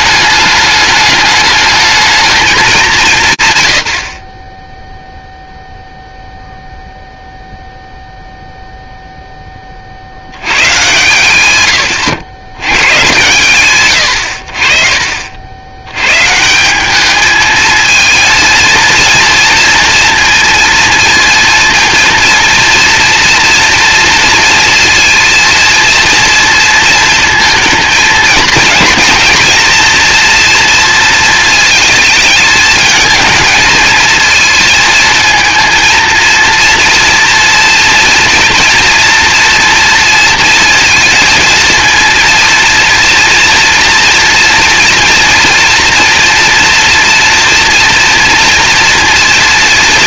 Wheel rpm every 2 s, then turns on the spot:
210, 190, 0, 0, 0, 110, 90, 50, 180, 230, 230, 230, 230, 230, 230, 230, 220, 220, 230, 230, 230, 230, 230, 230, 230.
none